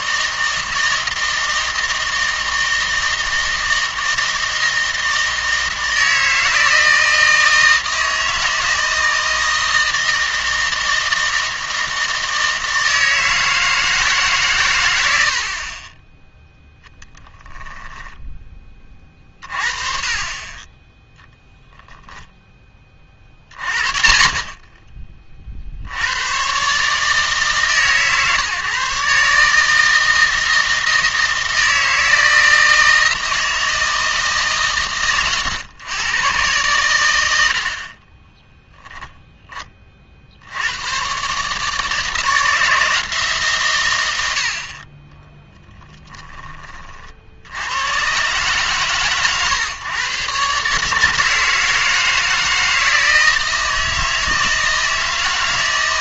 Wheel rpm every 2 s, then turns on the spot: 160, 160, 160, 160, 160, 160, 160, 110, 10, 30, 20, 20, 30, 140, 140, 160, 160, 130, 110, 0, 100, 160, 50, 20, 140, 140, 160, 160.
16-18